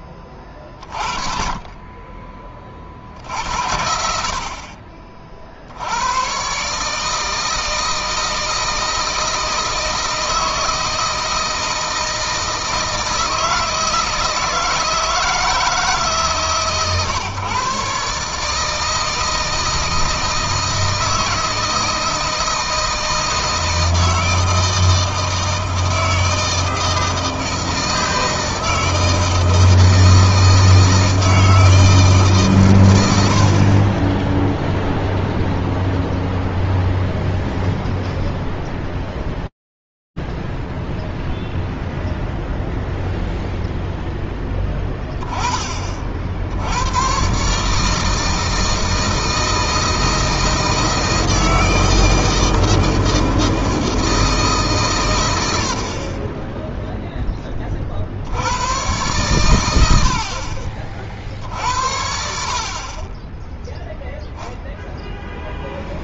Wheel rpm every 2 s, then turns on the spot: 30, 40, 50, 130, 160, 160, 160, 160, 140, 150, 160, 160, 160, 160, 160, 160, 120, 0, 0, 0, 0, 0, 20, 130, 160, 160, 160, 110, 0, 110, 40, 30, 0.
none